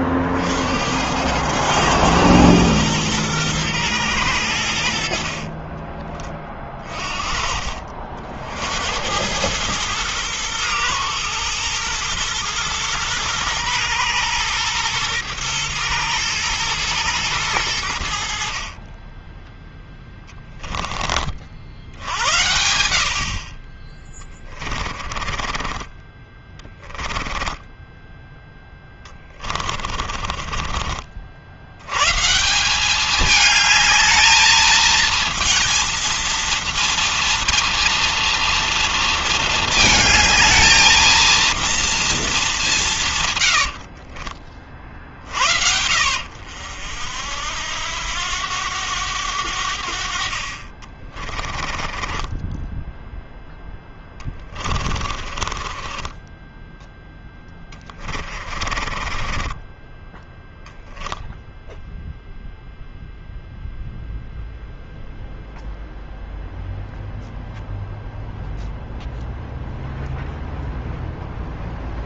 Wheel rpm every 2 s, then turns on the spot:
60, 110, 100, 20, 60, 110, 110, 120, 110, 80, 10, 80, 20, 20, 10, 30, 160, 220, 230, 230, 220, 210, 50, 70, 90, 50, 20, 20, 10, 30, 10, 0, 0, 0, 0, 0.
24-28 30-32 52-60